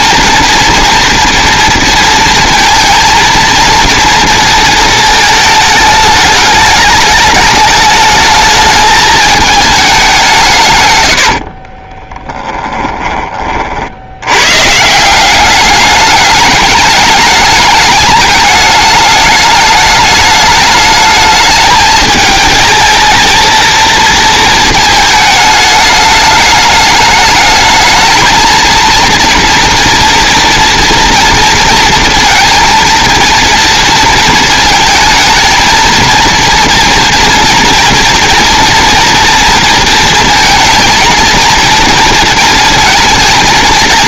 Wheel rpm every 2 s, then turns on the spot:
230, 230, 220, 210, 210, 130, 10, 160, 210, 210, 220, 220, 220, 210, 230, 230, 230, 220, 240, 240, 230, 230.
10-14